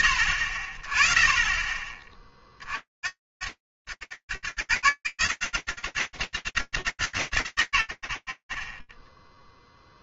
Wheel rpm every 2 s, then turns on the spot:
60, 60, 0, 0, 40.
none